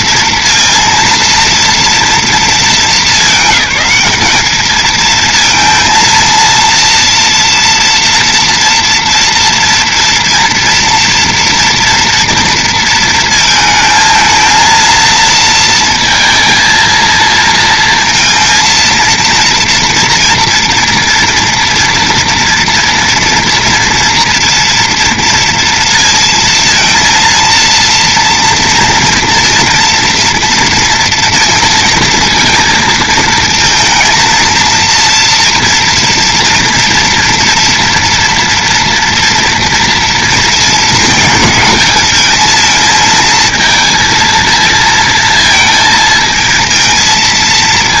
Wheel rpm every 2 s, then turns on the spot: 230, 210, 210, 230, 230, 230, 230, 220, 230, 230, 230, 230, 230, 230, 230, 230, 230, 230, 240, 230, 220, 220, 230, 220.
none